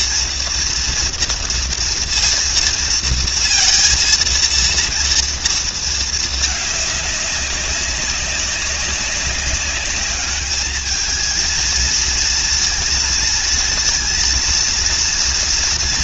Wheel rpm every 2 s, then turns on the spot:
230, 230, 230, 220, 200, 210, 230, 230.
none